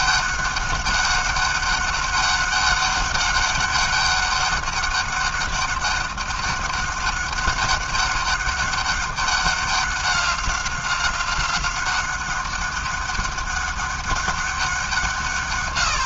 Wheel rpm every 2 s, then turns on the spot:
200, 200, 200, 200, 200, 190, 200, 180.
none